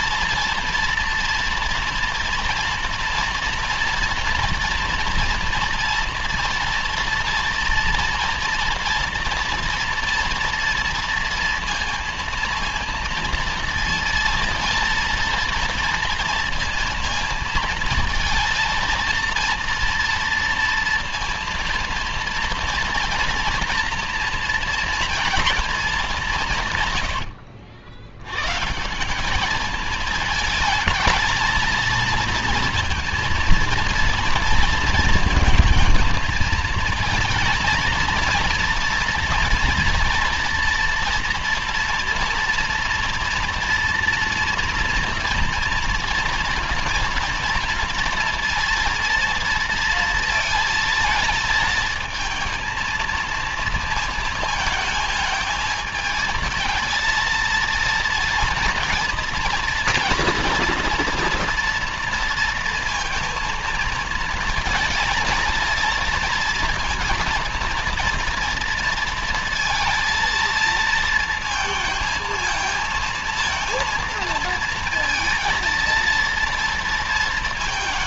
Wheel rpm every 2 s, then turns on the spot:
230, 230, 240, 230, 230, 230, 230, 230, 230, 230, 230, 230, 230, 100, 180, 220, 230, 230, 230, 230, 230, 230, 230, 230, 230, 220, 230, 220, 230, 230, 230, 220, 220, 230, 230, 230, 220, 220, 230.
26-28